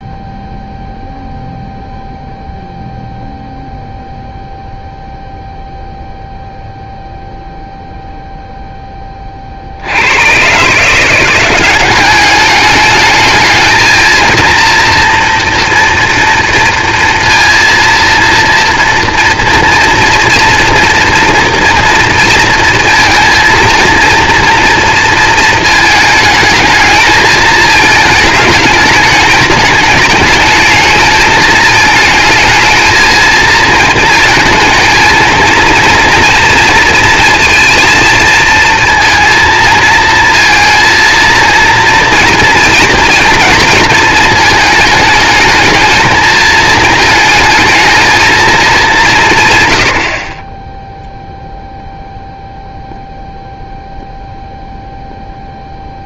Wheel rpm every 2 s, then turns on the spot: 0, 0, 0, 0, 10, 180, 220, 230, 230, 230, 230, 230, 230, 220, 210, 220, 220, 230, 230, 230, 230, 230, 220, 220, 200, 0, 0, 0.
none